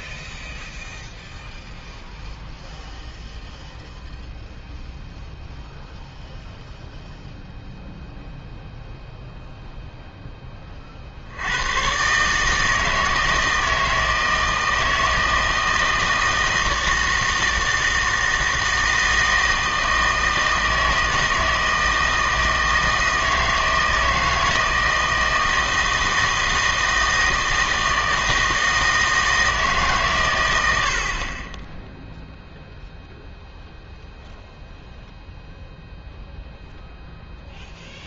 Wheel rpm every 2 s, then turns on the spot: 0, 0, 0, 0, 0, 40, 160, 160, 160, 160, 160, 160, 160, 160, 160, 60, 0, 0, 0.
none